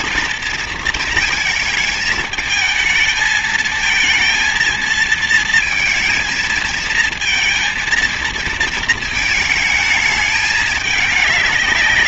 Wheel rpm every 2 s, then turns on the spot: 220, 220, 230, 230, 230, 210.
none